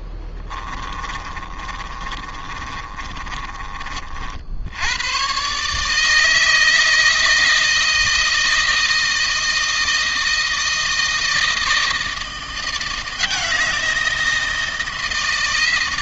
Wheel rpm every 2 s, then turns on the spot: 30, 30, 80, 160, 160, 160, 170, 170.
0-4